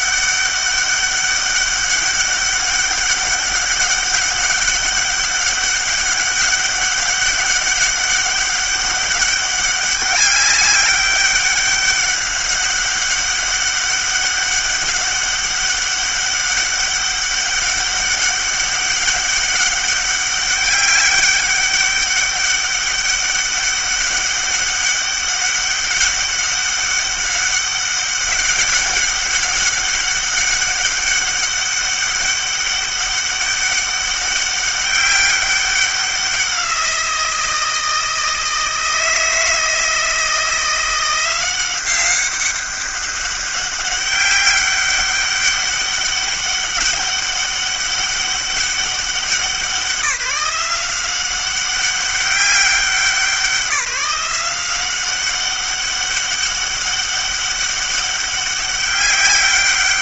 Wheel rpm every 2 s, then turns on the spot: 200, 200, 200, 200, 200, 200, 200, 200, 200, 200, 200, 200, 200, 200, 200, 200, 200, 200, 180, 160, 170, 200, 200, 200, 190, 180, 190, 180, 200, 200.
none